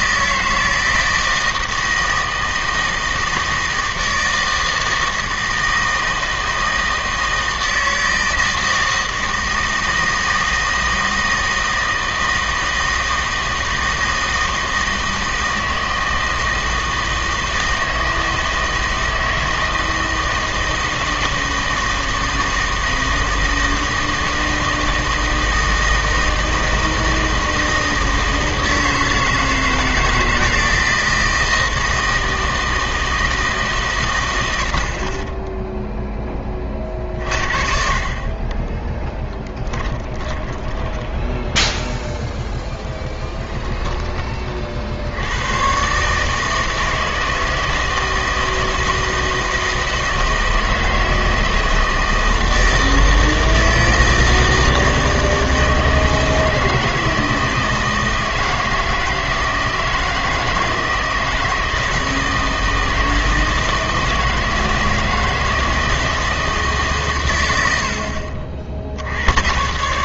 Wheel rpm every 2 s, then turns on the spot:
160, 160, 160, 160, 160, 160, 160, 160, 160, 160, 160, 160, 160, 160, 160, 160, 160, 60, 30, 20, 10, 0, 40, 160, 160, 160, 160, 160, 160, 160, 160, 160, 160, 150, 50.
38-42